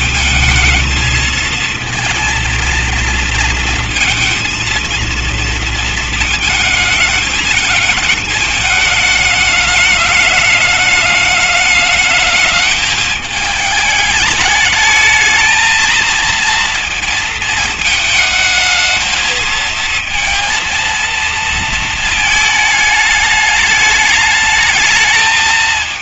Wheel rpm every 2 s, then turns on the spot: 220, 230, 230, 220, 220, 210, 210, 220, 230, 220, 230, 210, 220.
none